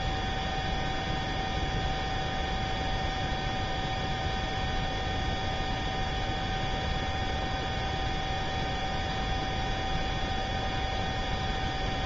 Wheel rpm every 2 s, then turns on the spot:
0, 0, 0, 0, 0, 0.
none